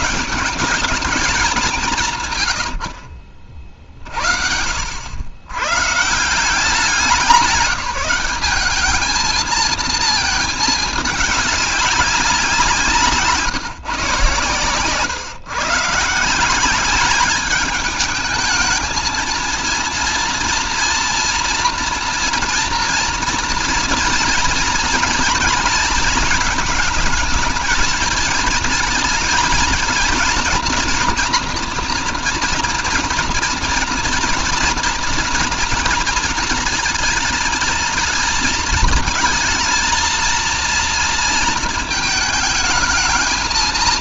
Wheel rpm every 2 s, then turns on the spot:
200, 60, 90, 200, 220, 210, 160, 130, 200, 230, 230, 230, 230, 210, 220, 230, 230, 230, 220, 220, 230, 220.
none